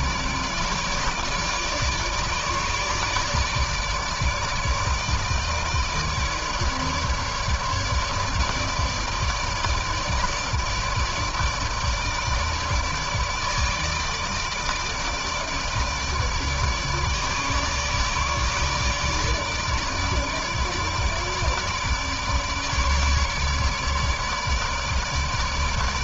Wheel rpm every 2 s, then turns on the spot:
150, 150, 160, 150, 150, 160, 150, 160, 150, 150, 150, 150, 150.
none